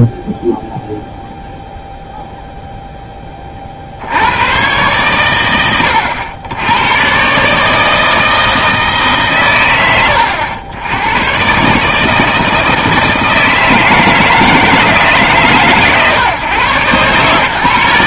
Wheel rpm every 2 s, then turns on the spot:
0, 0, 90, 110, 160, 100, 160, 160, 130.
none